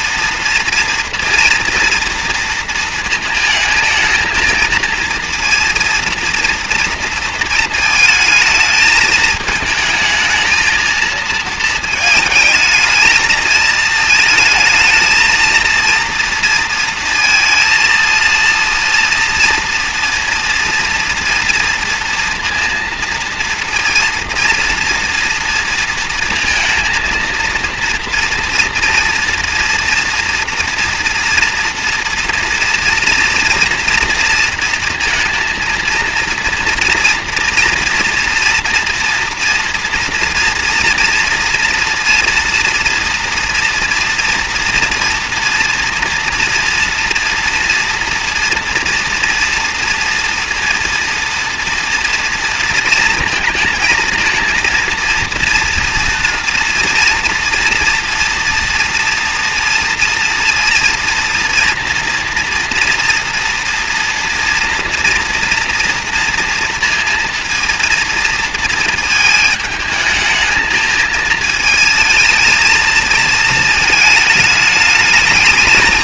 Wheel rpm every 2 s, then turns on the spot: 230, 230, 230, 230, 220, 230, 220, 230, 230, 230, 240, 230, 230, 230, 230, 230, 240, 230, 230, 240, 230, 230, 240, 230, 230, 230, 230, 230, 240, 230, 230, 240, 230, 230, 220, 220, 220, 220.
none